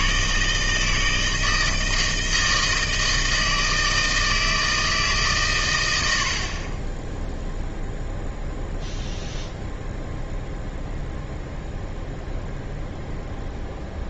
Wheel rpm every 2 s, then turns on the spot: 160, 160, 160, 20, 0, 0, 0.
none